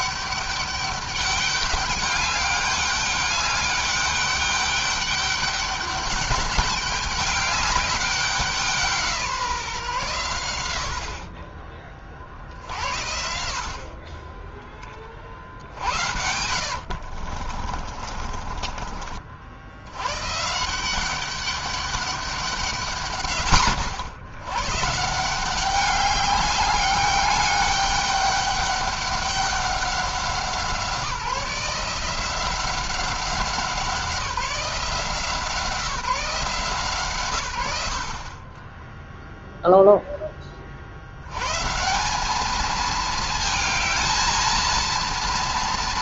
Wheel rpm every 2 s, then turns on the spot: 200, 200, 200, 200, 170, 70, 70, 20, 60, 40, 170, 160, 140, 200, 200, 170, 190, 170, 150, 10, 50, 220, 230.
16-18